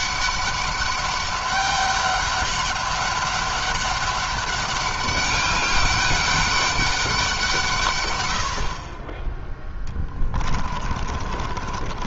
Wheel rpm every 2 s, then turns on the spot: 200, 200, 200, 200, 50, 30.
10-12